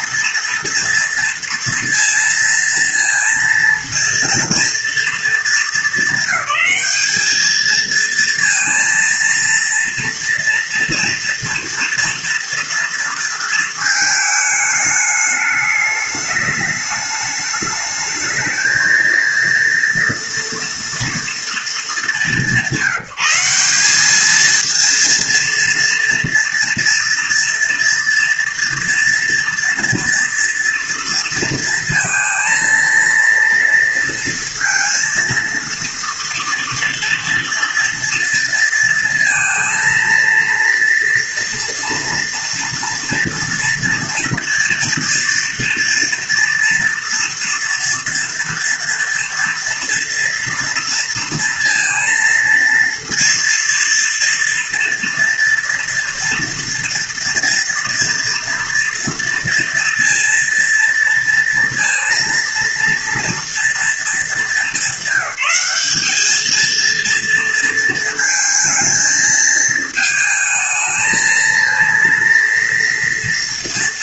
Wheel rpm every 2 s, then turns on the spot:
230, 230, 220, 210, 230, 230, 230, 210, 210, 230, 230, 180, 230, 230, 230, 230, 230, 230, 230, 230, 230, 230, 230, 230, 230, 230, 230, 230, 230, 230, 230, 230, 200, 230, 230, 230, 230.
none